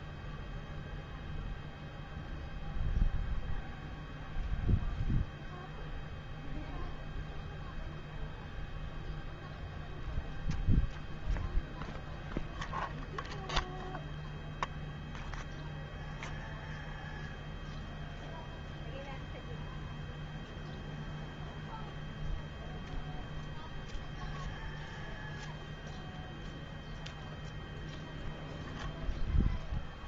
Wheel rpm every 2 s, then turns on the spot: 0, 0, 0, 0, 0, 0, 0, 0, 0, 0, 0, 0, 0, 0, 0.
none